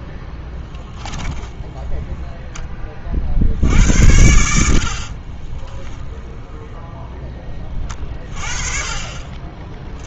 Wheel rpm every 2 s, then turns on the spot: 10, 20, 70, 0, 30.
none